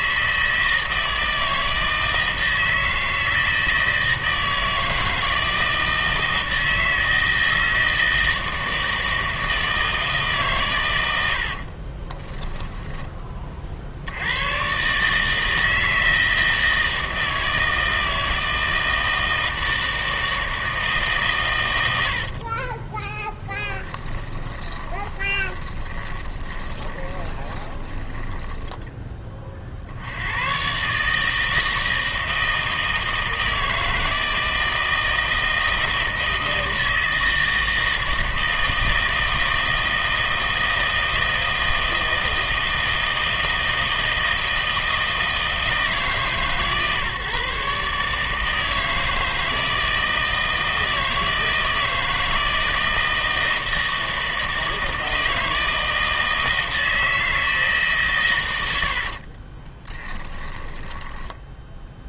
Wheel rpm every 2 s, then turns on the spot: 160, 160, 160, 160, 160, 120, 10, 120, 160, 160, 150, 20, 10, 20, 10, 130, 160, 160, 160, 160, 160, 160, 160, 140, 160, 160, 160, 160, 160, 90, 10.
22-30 58-62